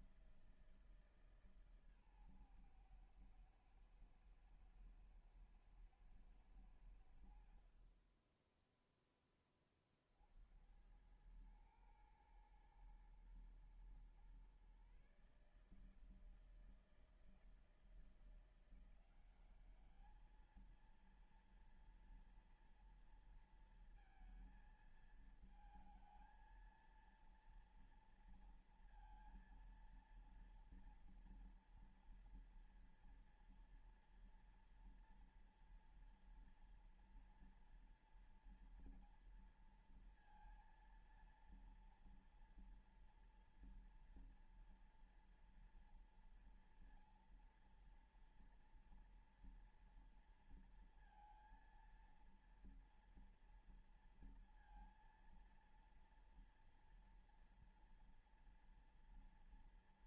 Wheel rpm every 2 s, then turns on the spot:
170, 130, 110, 110, 20, 70, 110, 130, 160, 170, 220, 230, 230, 230, 230, 230, 230, 230, 240, 240, 230, 230, 240, 230, 230, 230, 230, 230, 230, 230.
8-10